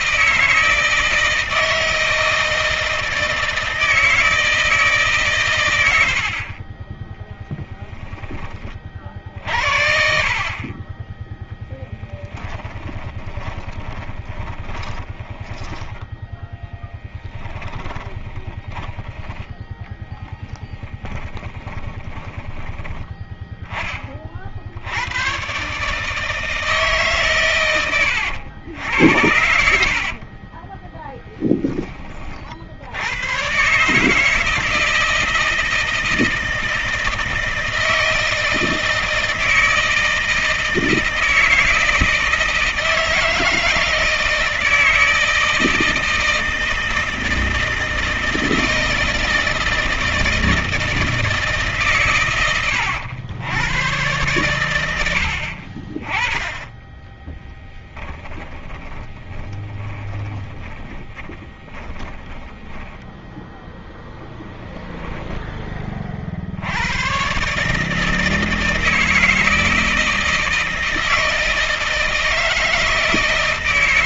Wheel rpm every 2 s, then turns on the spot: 160, 160, 150, 20, 40, 20, 20, 20, 10, 20, 20, 20, 90, 140, 70, 10, 100, 160, 160, 160, 160, 160, 160, 160, 160, 160, 100, 80, 10, 20, 30, 10, 0, 110, 160, 160, 160.
12-18 20-22 56-64